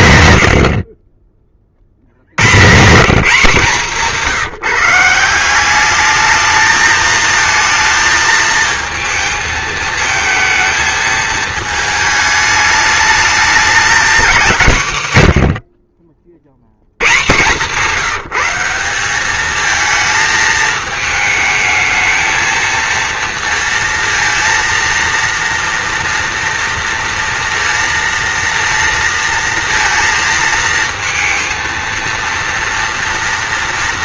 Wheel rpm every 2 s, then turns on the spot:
60, 160, 170, 220, 220, 220, 210, 140, 100, 190, 220, 230, 230, 230, 230, 220, 230.
none